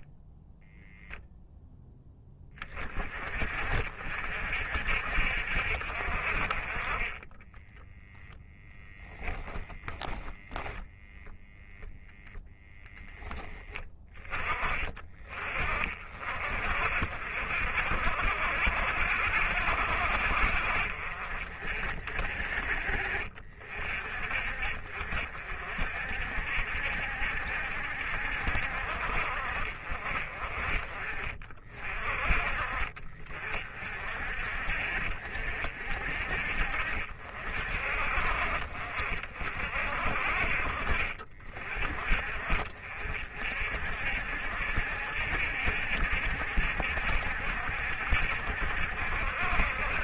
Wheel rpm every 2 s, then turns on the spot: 0, 30, 60, 20, 10, 0, 10, 30, 50, 60, 50, 40, 50, 60, 60, 40, 40, 50, 50, 50, 40, 50, 70, 60, 70.
8-10